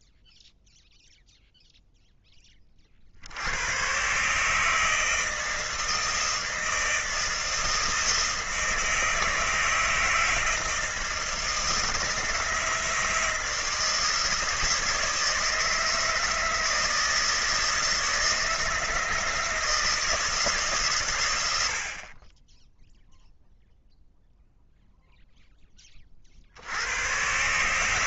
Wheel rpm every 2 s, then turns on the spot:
0, 40, 160, 160, 160, 160, 160, 160, 160, 160, 140, 10, 0, 90.
none